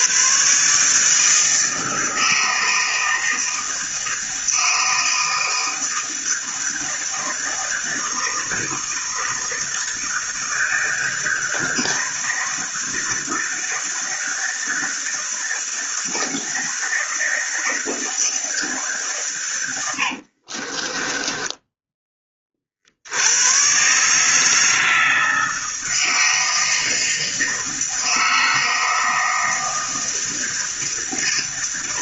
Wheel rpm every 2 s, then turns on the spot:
140, 160, 160, 160, 160, 160, 160, 160, 160, 150, 30, 60, 160, 160, 160, 160.
20-22